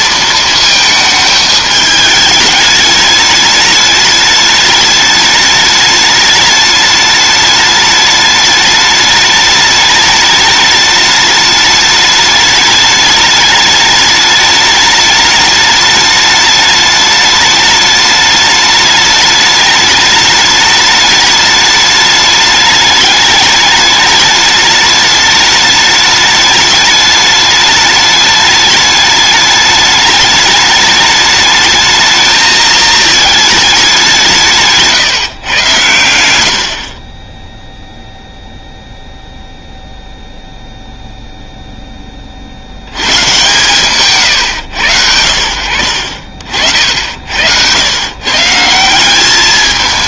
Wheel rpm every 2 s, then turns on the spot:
220, 210, 210, 210, 210, 210, 210, 210, 210, 210, 210, 210, 210, 210, 210, 210, 220, 160, 60, 0, 0, 80, 100, 50, 160.
36-38